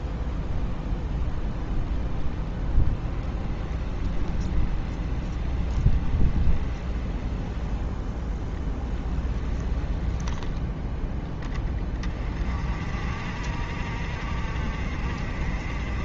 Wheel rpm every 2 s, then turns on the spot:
10, 10, 20, 20, 10, 10, 40, 40.
2-10